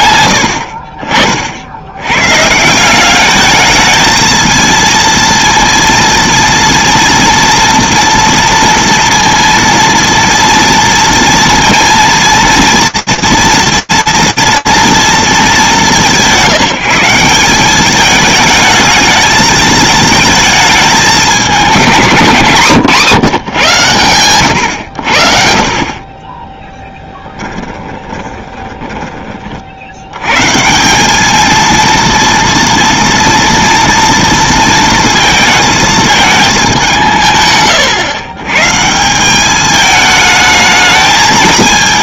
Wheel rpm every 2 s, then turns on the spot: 60, 160, 230, 240, 240, 230, 230, 220, 170, 220, 200, 140, 80, 10, 10, 180, 230, 220, 180, 160, 210.
26-30